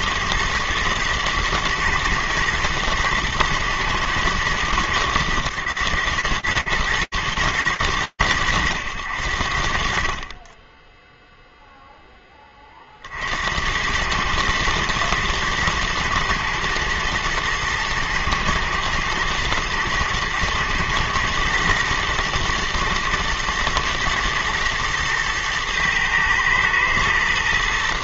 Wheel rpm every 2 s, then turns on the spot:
110, 110, 110, 110, 90, 10, 50, 110, 120, 120, 120, 120, 110, 110.
none